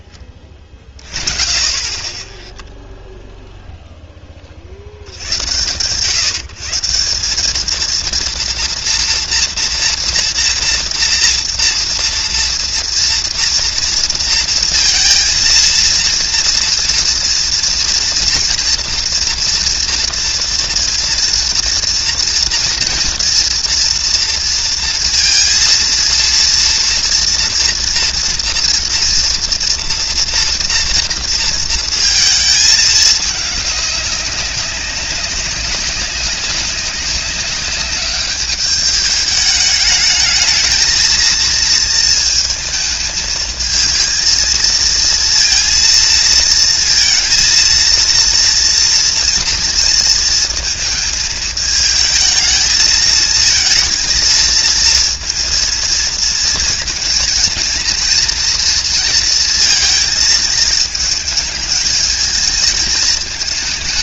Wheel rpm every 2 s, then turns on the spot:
20, 0, 50, 160, 230, 230, 230, 230, 230, 230, 230, 230, 230, 230, 230, 230, 220, 200, 190, 210, 220, 220, 230, 230, 230, 220, 220, 230, 230, 230, 220, 220.
none